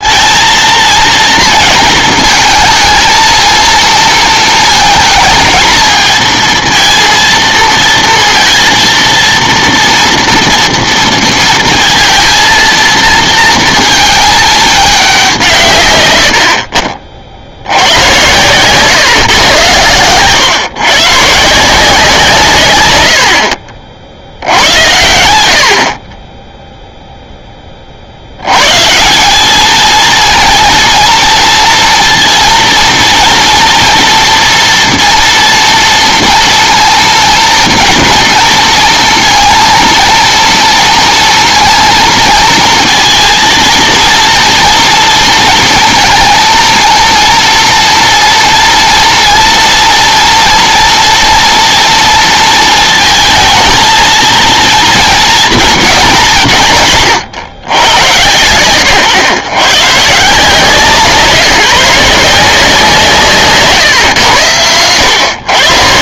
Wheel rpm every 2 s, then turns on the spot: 220, 230, 230, 230, 230, 230, 230, 210, 50, 130, 130, 140, 80, 10, 110, 230, 230, 230, 230, 230, 230, 230, 230, 230, 230, 230, 230, 230, 180, 110, 160, 170, 100.
none